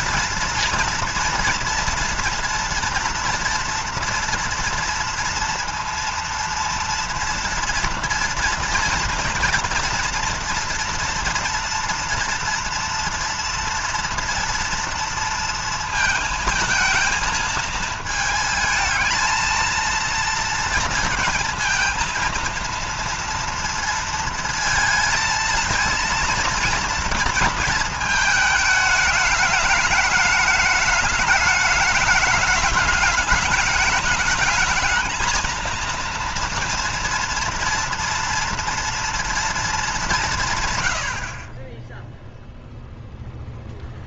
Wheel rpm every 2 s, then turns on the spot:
240, 240, 230, 230, 230, 230, 240, 230, 220, 220, 230, 230, 230, 230, 220, 210, 210, 220, 230, 230, 110, 0.
none